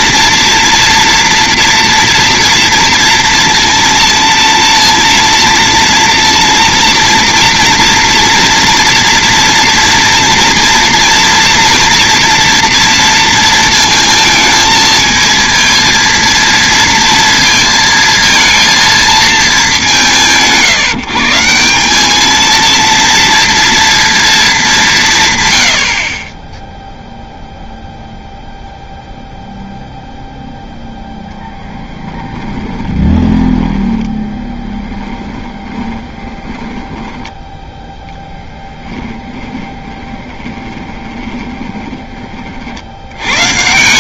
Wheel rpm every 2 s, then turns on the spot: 230, 230, 230, 230, 230, 230, 230, 220, 230, 230, 150, 220, 210, 10, 0, 0, 10, 10, 10, 20, 20, 40.
32-42